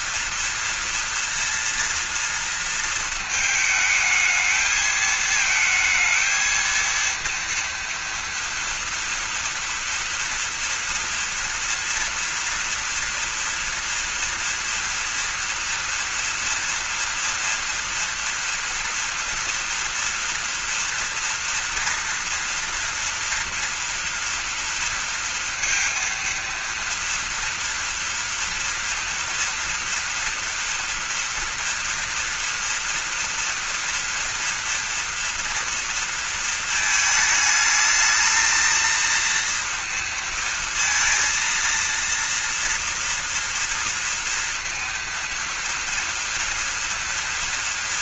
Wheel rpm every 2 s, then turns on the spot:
230, 230, 220, 230, 240, 230, 230, 230, 230, 230, 230, 230, 230, 230, 230, 230, 230, 230, 220, 230, 230, 230, 230, 230.
none